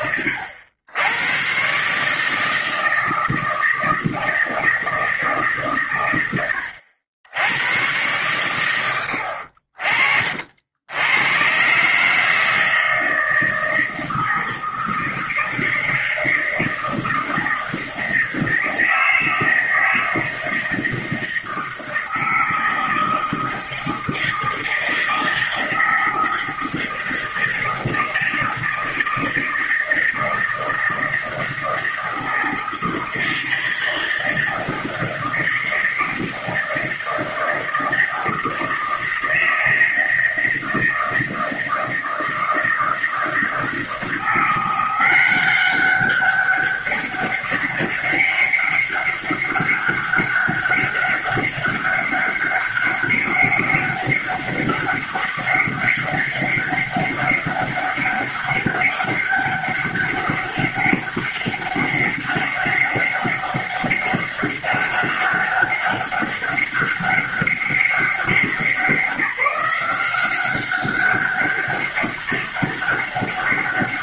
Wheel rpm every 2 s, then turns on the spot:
100, 160, 160, 80, 80, 90, 160, 160, 160, 160, 160, 160, 160, 160, 160, 160, 160, 160, 160, 160, 160, 160, 180, 200, 200, 200, 200, 200, 200, 200, 200, 200, 200, 200, 190, 190, 200.
none